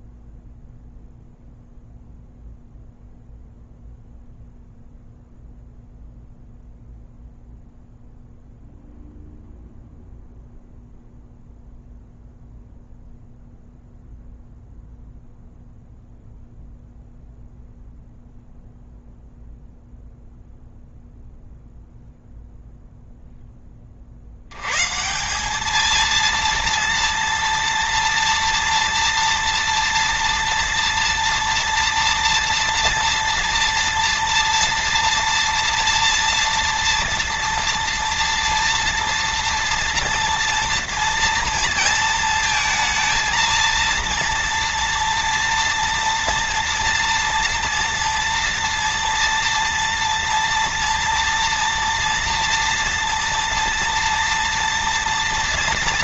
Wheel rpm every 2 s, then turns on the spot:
0, 0, 0, 0, 0, 0, 0, 0, 0, 0, 0, 0, 110, 230, 230, 230, 230, 230, 230, 230, 230, 230, 230, 230, 240, 230, 230, 230.
none